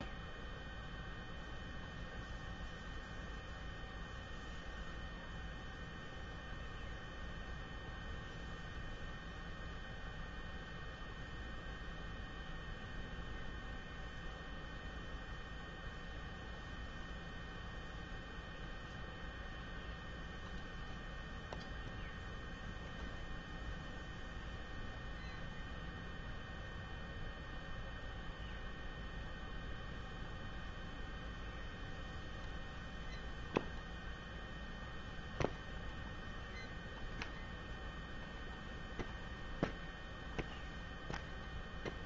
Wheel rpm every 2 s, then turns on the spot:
0, 0, 0, 0, 0, 0, 0, 0, 0, 0, 0, 0, 0, 0, 0, 0, 0, 0, 0, 0, 0.
none